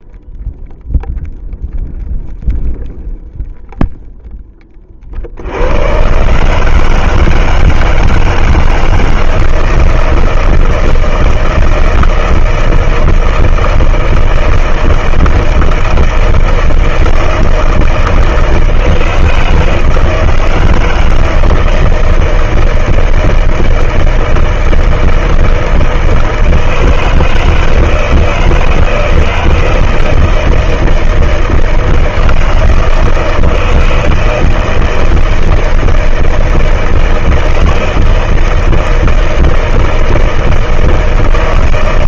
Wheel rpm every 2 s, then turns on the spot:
0, 0, 0, 60, 160, 160, 160, 160, 160, 160, 160, 160, 160, 160, 160, 160, 160, 160, 160, 160, 160.
none